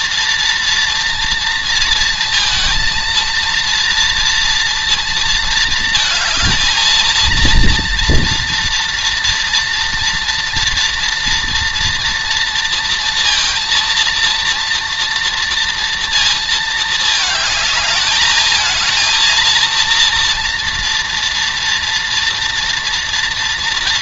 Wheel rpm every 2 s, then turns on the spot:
230, 230, 230, 220, 240, 230, 230, 230, 220, 220, 240, 230.
none